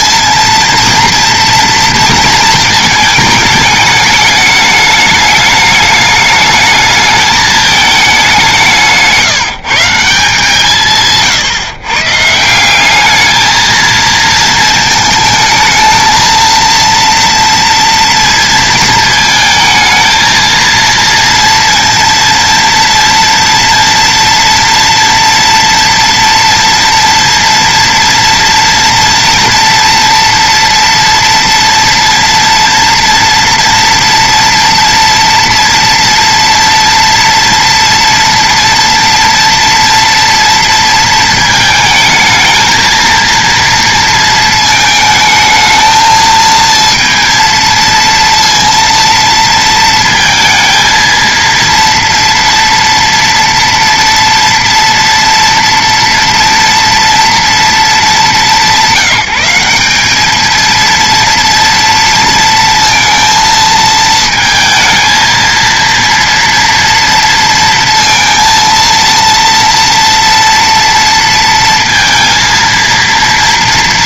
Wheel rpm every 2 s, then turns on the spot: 230, 220, 210, 220, 180, 160, 170, 220, 230, 230, 230, 230, 230, 230, 230, 230, 230, 230, 230, 230, 230, 220, 220, 230, 230, 230, 230, 230, 230, 200, 220, 230, 220, 230, 230, 230, 230.
none